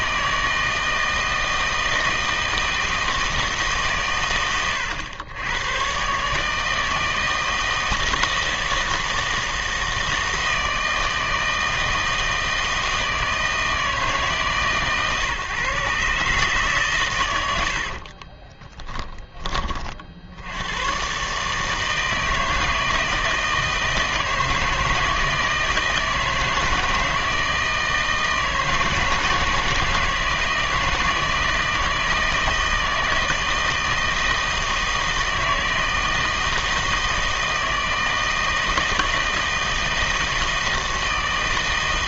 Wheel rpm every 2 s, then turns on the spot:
160, 160, 110, 160, 160, 160, 160, 150, 130, 10, 90, 160, 160, 160, 160, 160, 160, 160, 160, 160, 160.
18-20